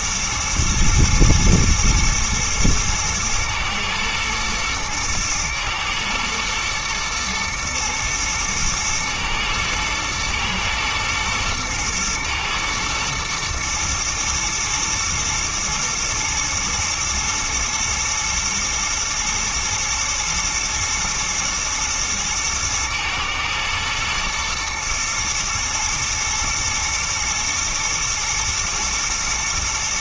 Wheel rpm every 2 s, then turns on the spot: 110, 110, 110, 110, 110, 110, 110, 120, 120, 120, 120, 110, 120, 110, 110.
none